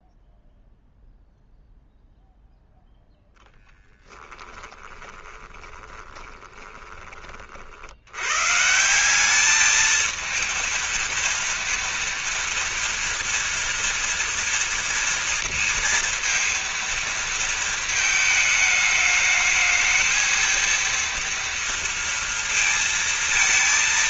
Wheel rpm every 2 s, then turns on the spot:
0, 0, 20, 20, 190, 230, 230, 230, 230, 210, 230, 230.
4-6